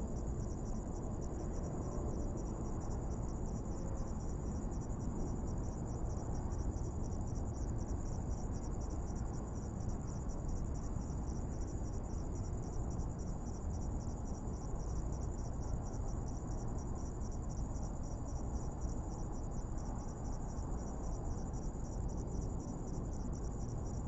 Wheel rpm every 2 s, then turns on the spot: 0, 0, 0, 0, 0, 0, 0, 0, 0, 0, 0, 0.
none